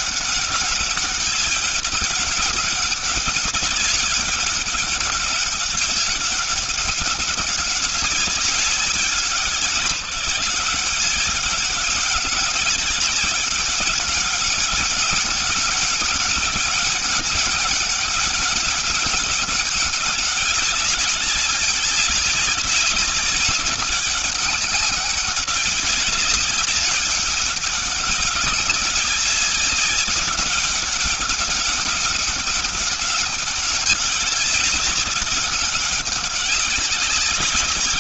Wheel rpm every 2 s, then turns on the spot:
200, 200, 200, 190, 190, 190, 200, 200, 200, 200, 200, 190, 190, 200, 200, 200, 200, 200, 190.
none